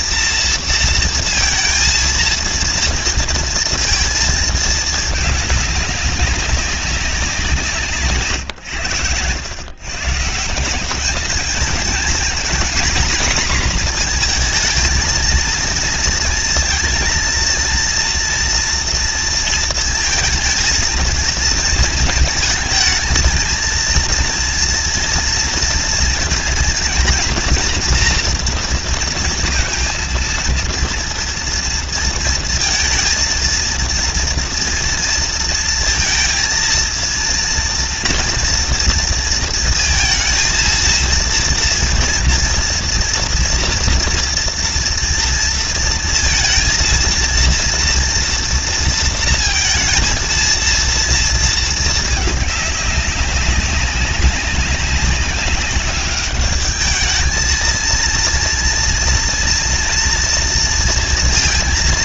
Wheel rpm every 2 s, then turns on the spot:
230, 230, 220, 200, 130, 150, 240, 230, 230, 230, 220, 220, 230, 220, 230, 230, 230, 230, 230, 230, 230, 230, 230, 230, 230, 230, 210, 190, 210, 230, 230.
none